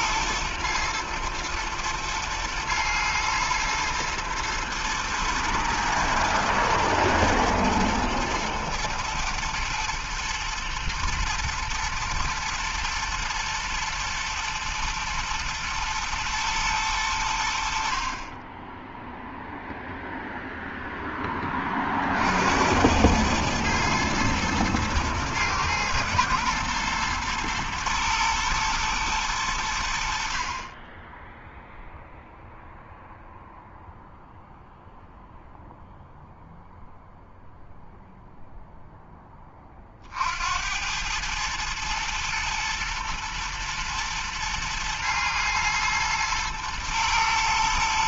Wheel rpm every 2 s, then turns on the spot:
110, 110, 120, 110, 110, 110, 110, 110, 90, 0, 10, 100, 120, 120, 110, 10, 0, 0, 0, 10, 110, 110, 110, 110.
none